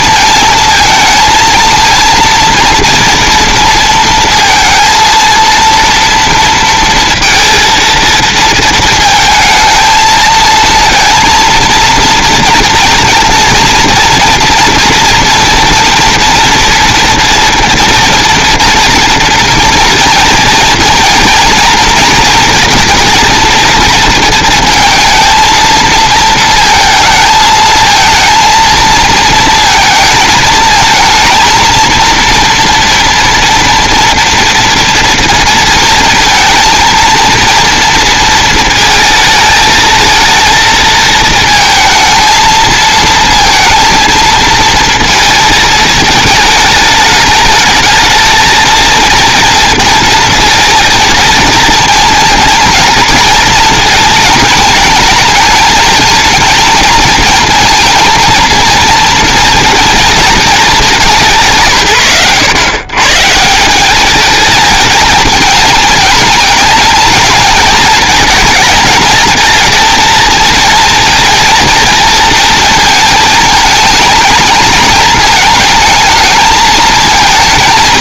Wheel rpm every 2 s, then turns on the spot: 220, 230, 230, 230, 230, 230, 230, 230, 230, 230, 230, 230, 220, 230, 230, 220, 230, 230, 230, 220, 220, 220, 230, 220, 230, 230, 230, 220, 230, 230, 190, 140, 220, 220, 230, 230, 230, 220, 220.
none